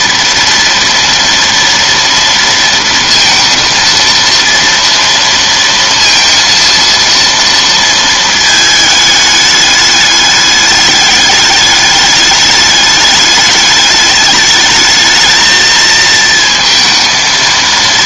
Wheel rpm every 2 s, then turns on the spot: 230, 230, 230, 230, 220, 210, 210, 220, 230.
none